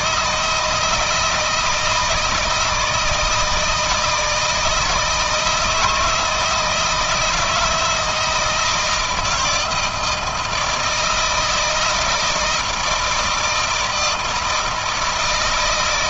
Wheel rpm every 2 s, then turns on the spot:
160, 160, 160, 170, 160, 160, 160, 160.
none